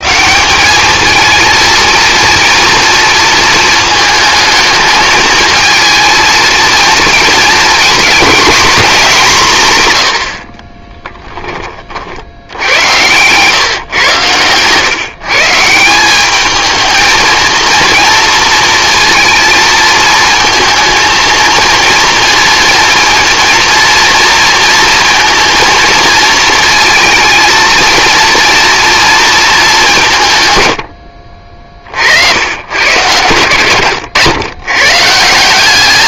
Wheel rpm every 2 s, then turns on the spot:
190, 230, 220, 230, 220, 40, 90, 120, 220, 230, 230, 230, 230, 230, 230, 130, 90, 110.
10-12